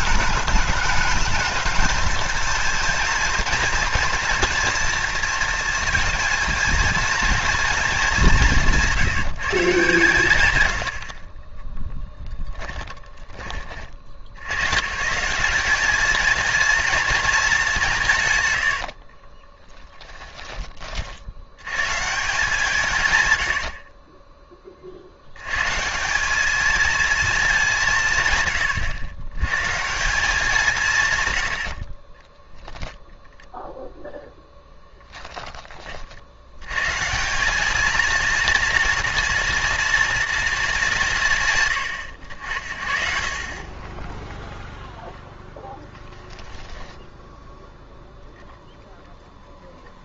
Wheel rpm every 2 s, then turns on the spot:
210, 230, 230, 230, 170, 100, 10, 130, 230, 80, 30, 150, 30, 220, 110, 160, 0, 10, 130, 230, 200, 50, 0, 10, 0.
12-14 18-20 46-48